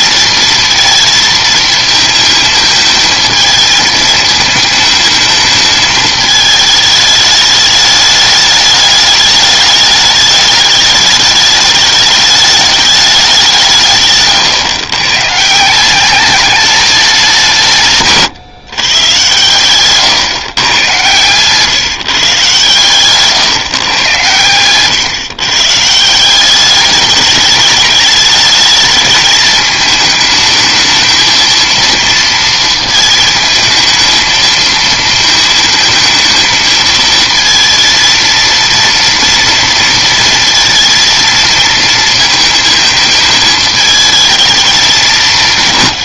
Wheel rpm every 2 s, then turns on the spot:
230, 220, 220, 220, 210, 210, 210, 130, 200, 140, 120, 140, 110, 190, 210, 220, 230, 220, 220, 230, 230, 220, 220.
none